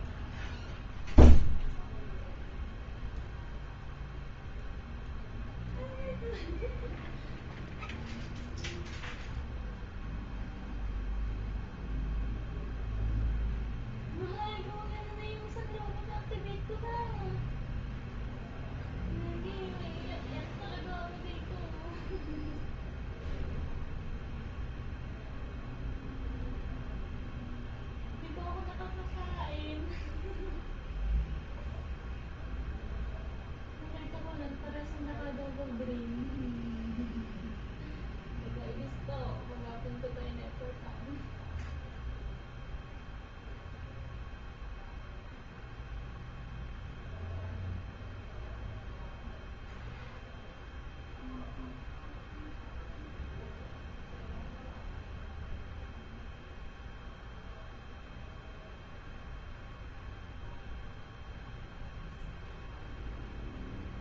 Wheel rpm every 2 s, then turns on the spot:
0, 0, 0, 0, 0, 0, 0, 0, 0, 0, 0, 0, 0, 0, 0, 0, 0, 0, 0, 0, 0, 0, 0, 0, 0, 0, 0, 0, 0, 0, 0, 0.
none